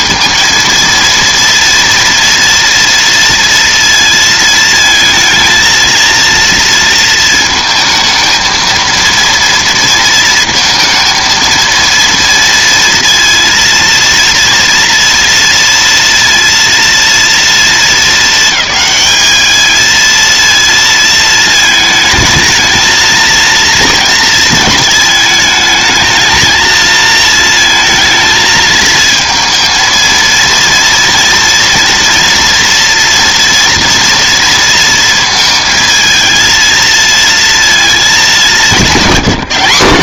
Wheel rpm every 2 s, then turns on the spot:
230, 230, 230, 230, 220, 230, 230, 230, 230, 220, 230, 220, 220, 220, 220, 230, 240, 230, 230, 200.
none